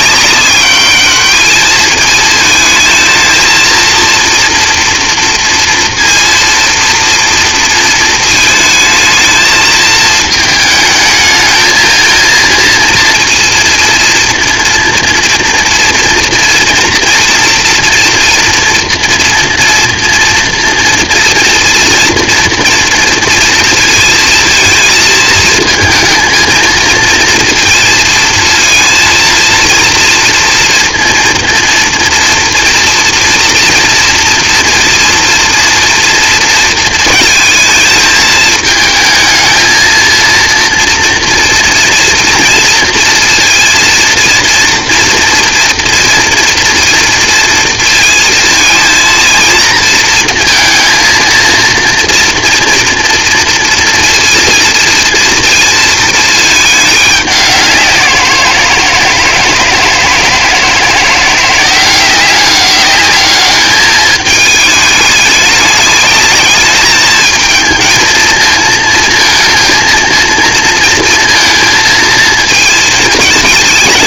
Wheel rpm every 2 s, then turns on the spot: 210, 220, 230, 230, 220, 220, 230, 230, 230, 230, 230, 230, 220, 220, 230, 240, 240, 230, 230, 220, 230, 230, 230, 230, 230, 220, 230, 230, 210, 170, 160, 190, 210, 220, 220, 230, 220.
none